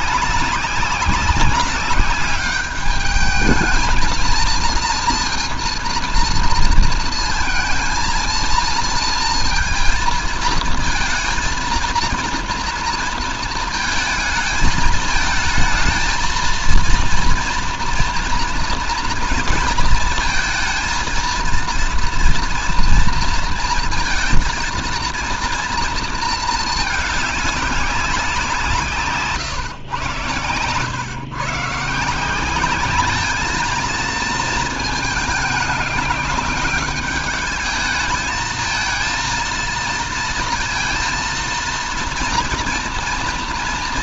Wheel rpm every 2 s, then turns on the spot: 200, 210, 230, 230, 230, 230, 230, 220, 230, 230, 230, 240, 230, 220, 160, 120, 200, 220, 210, 220, 230, 240.
none